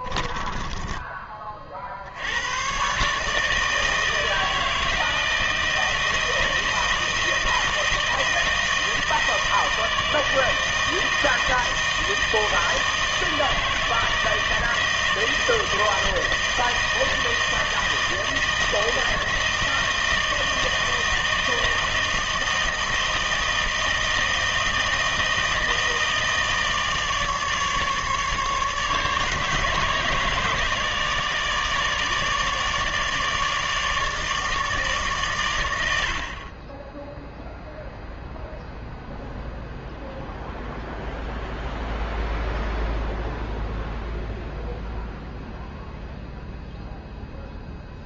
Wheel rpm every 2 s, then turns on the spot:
10, 110, 160, 160, 160, 160, 160, 160, 160, 160, 160, 160, 160, 160, 150, 150, 150, 150, 20, 0, 0, 0, 0, 0.
0-2